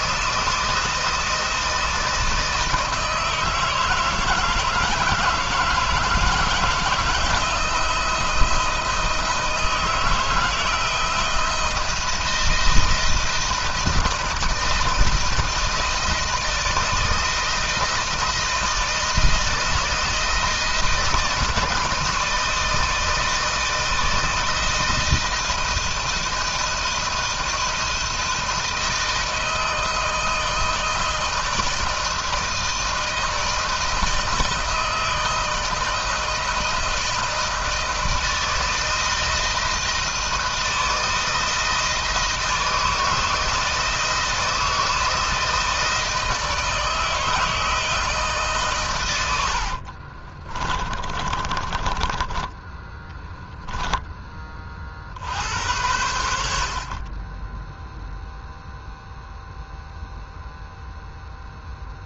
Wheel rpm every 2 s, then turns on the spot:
160, 160, 160, 160, 160, 160, 170, 160, 160, 160, 160, 160, 160, 160, 160, 160, 160, 160, 160, 160, 160, 160, 160, 160, 130, 30, 10, 30, 60, 0, 0.
50-54